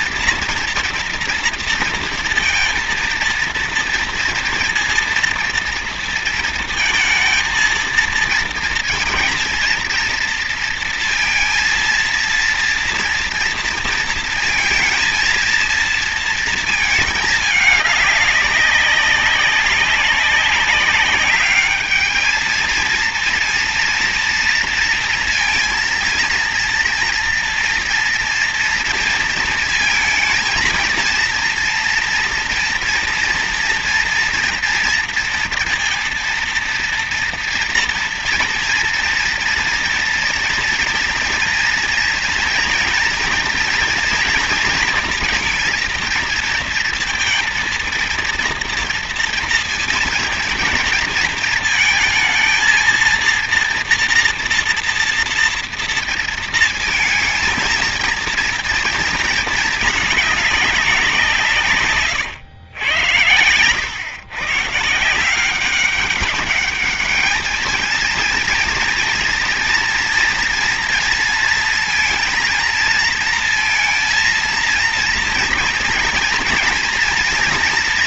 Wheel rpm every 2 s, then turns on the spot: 230, 230, 230, 230, 220, 230, 230, 230, 230, 200, 190, 220, 230, 230, 230, 230, 230, 230, 230, 230, 230, 230, 230, 230, 240, 230, 230, 230, 230, 230, 200, 110, 150, 210, 230, 240, 230, 230, 230.
none